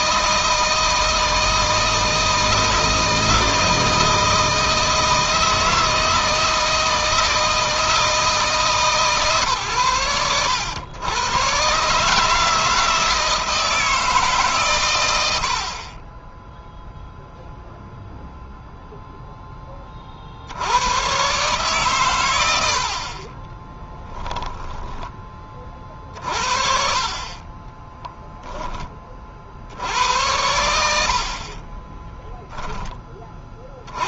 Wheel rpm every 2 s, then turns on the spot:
160, 160, 160, 160, 140, 100, 160, 120, 0, 0, 100, 70, 10, 40, 20, 70, 20.
none